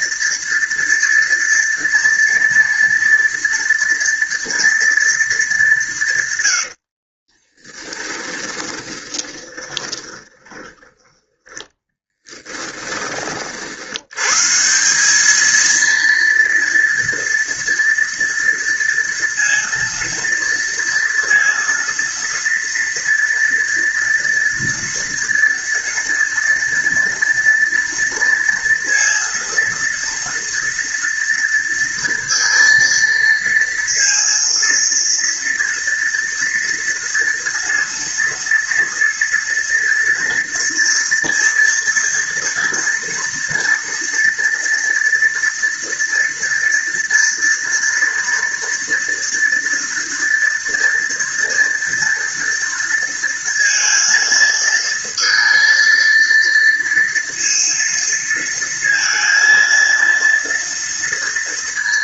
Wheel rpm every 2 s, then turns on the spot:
230, 230, 230, 60, 20, 10, 30, 190, 230, 230, 230, 230, 230, 230, 230, 230, 230, 230, 230, 230, 230, 230, 230, 230, 230, 230, 230, 230, 230, 230, 230.
6-12